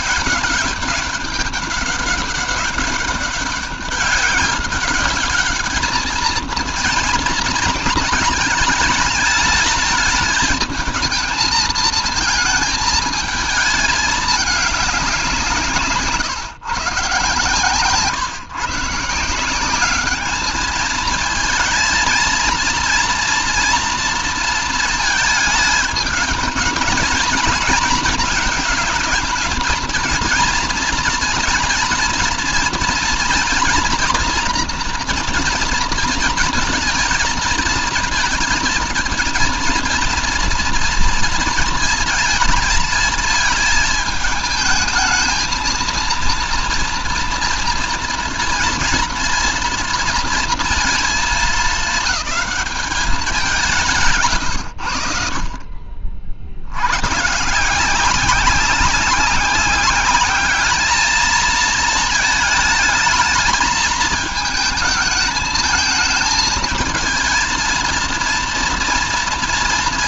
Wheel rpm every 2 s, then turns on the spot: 200, 200, 200, 230, 220, 220, 220, 190, 140, 150, 220, 230, 220, 220, 220, 230, 230, 230, 230, 230, 230, 220, 220, 230, 230, 230, 210, 80, 90, 190, 220, 220, 210, 230, 230.
none